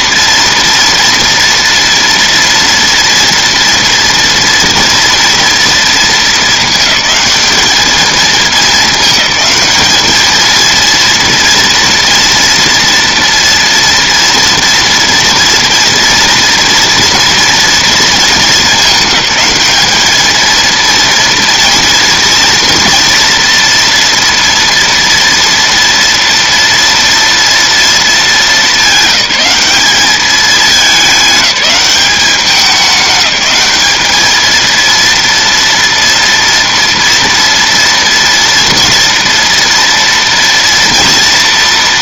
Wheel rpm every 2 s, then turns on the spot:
230, 230, 240, 220, 210, 230, 230, 240, 230, 210, 230, 230, 230, 230, 210, 210, 200, 220, 230, 230, 230.
none